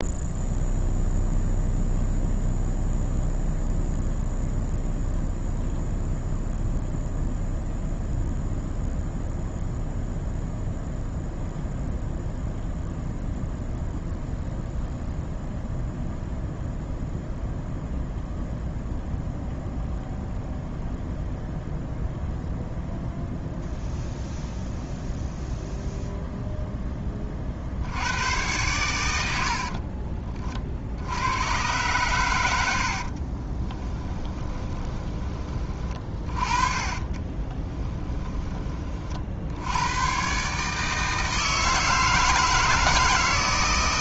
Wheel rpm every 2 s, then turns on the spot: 0, 0, 0, 0, 0, 0, 0, 0, 0, 0, 0, 0, 0, 20, 90, 70, 60, 20, 30, 30, 160, 160.
32-38